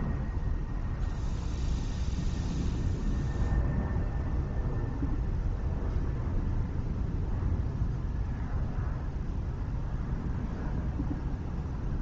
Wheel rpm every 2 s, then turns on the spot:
0, 0, 0, 0, 0, 0.
none